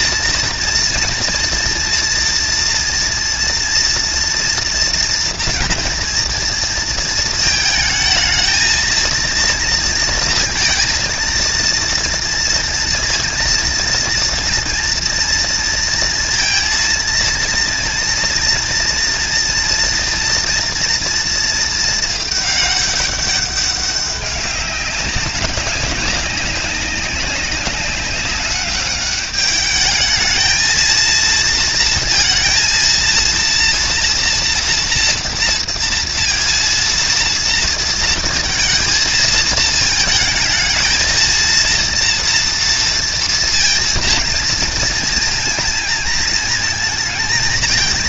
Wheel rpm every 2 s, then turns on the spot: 230, 230, 230, 230, 220, 230, 230, 230, 230, 230, 230, 200, 190, 190, 210, 230, 230, 240, 230, 230, 220, 230, 230, 230.
none